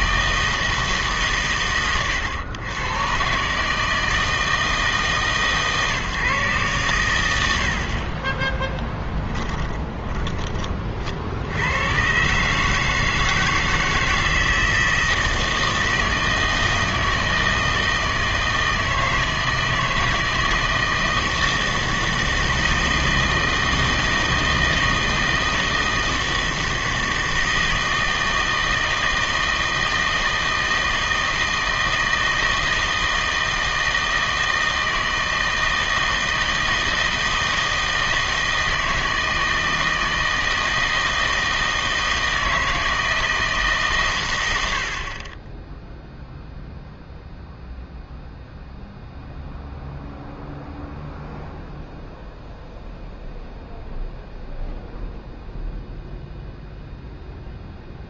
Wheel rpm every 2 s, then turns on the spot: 160, 110, 160, 120, 10, 30, 150, 160, 160, 160, 160, 160, 160, 160, 160, 160, 160, 160, 160, 160, 160, 160, 80, 0, 0, 0, 0, 0, 0.
8-10